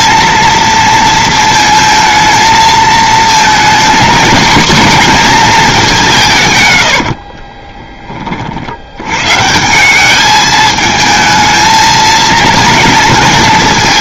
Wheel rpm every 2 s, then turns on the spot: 220, 240, 140, 40, 210, 230, 230.
none